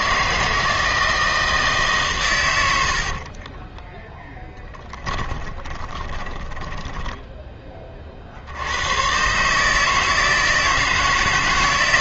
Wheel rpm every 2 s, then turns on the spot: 160, 80, 10, 10, 90, 160.
4-8